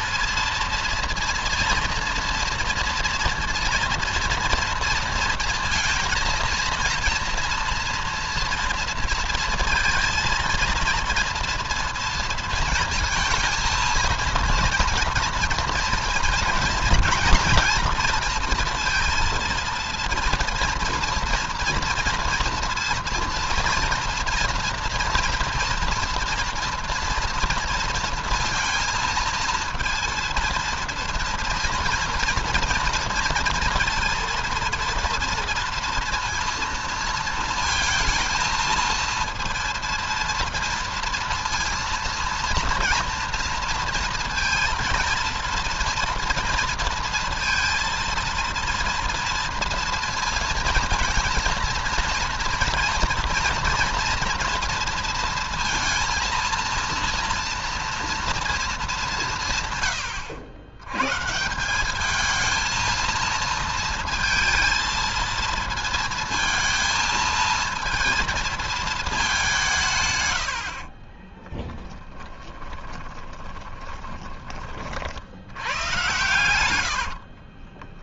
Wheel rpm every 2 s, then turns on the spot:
230, 230, 230, 230, 230, 230, 220, 230, 230, 230, 230, 230, 240, 230, 230, 230, 230, 230, 230, 230, 230, 230, 230, 230, 230, 230, 230, 230, 230, 210, 130, 230, 230, 230, 210, 40, 20, 60, 70.
70-74 76-78